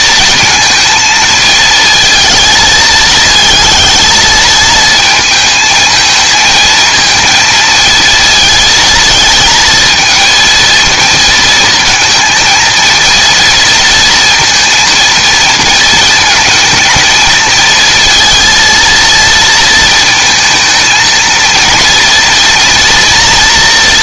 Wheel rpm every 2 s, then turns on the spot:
220, 220, 220, 220, 230, 230, 230, 230, 220, 230, 230, 240.
none